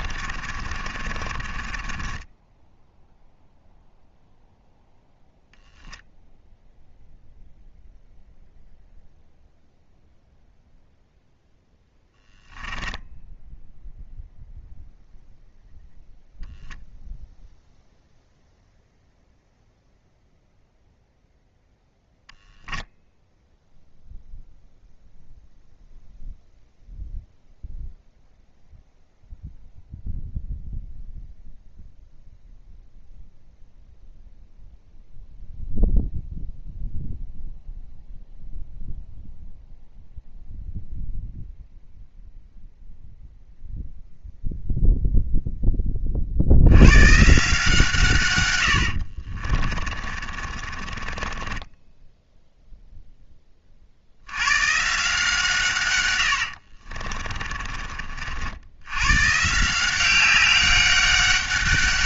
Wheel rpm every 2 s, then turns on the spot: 10, 0, 0, 0, 0, 0, 0, 0, 0, 0, 0, 0, 0, 0, 0, 0, 0, 0, 0, 0, 0, 0, 0, 90, 80, 30, 0, 120, 70, 80, 200.
0-2 48-52 56-58